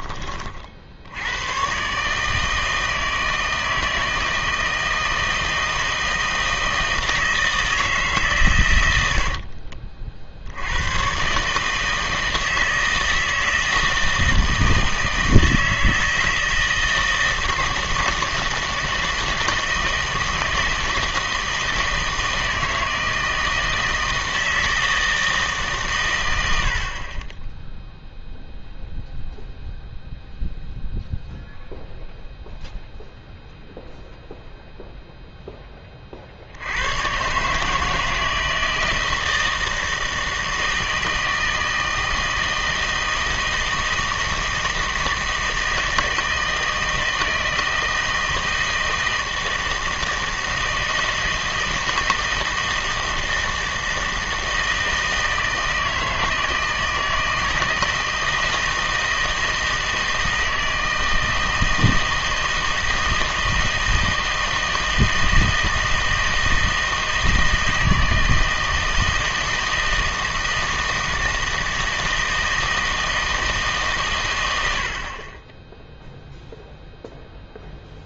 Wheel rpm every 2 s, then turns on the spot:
50, 160, 160, 160, 120, 80, 160, 160, 160, 160, 170, 160, 160, 70, 0, 0, 0, 0, 80, 160, 160, 160, 160, 160, 160, 160, 160, 160, 160, 160, 160, 160, 160, 160, 160, 160, 160, 70, 0.
none